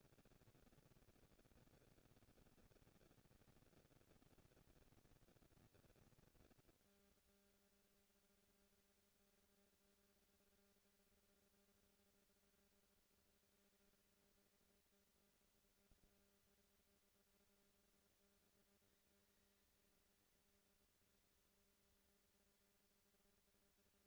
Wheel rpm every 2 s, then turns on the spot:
210, 220, 230, 230, 230, 230, 230, 230, 230, 230, 230, 230.
none